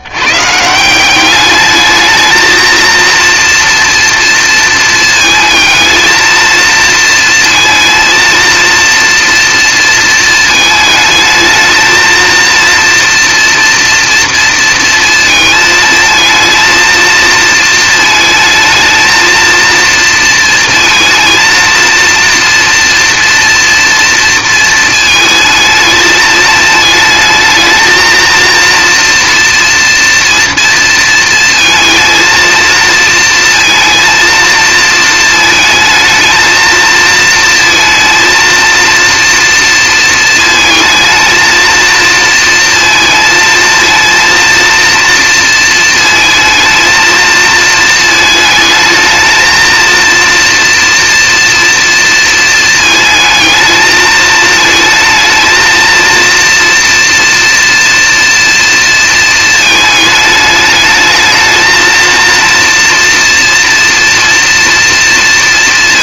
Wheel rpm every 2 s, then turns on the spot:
150, 230, 230, 230, 230, 220, 230, 230, 220, 220, 220, 230, 230, 220, 230, 240, 230, 230, 230, 230, 220, 230, 230, 220, 220, 230, 230, 220, 230, 230, 210, 230, 230.
none